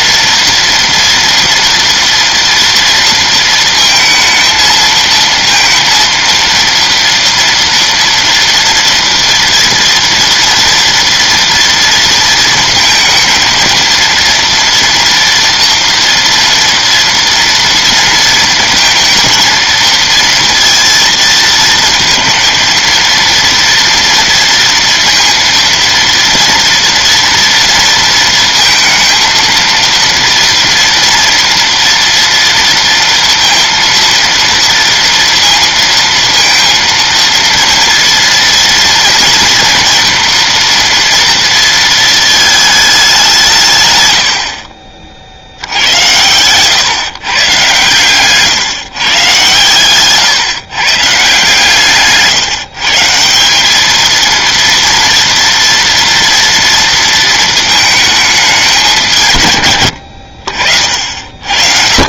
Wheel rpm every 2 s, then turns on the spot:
230, 230, 230, 230, 230, 240, 230, 230, 230, 230, 230, 230, 230, 230, 230, 230, 230, 230, 230, 230, 230, 210, 40, 110, 140, 150, 150, 230, 230, 210, 60.
none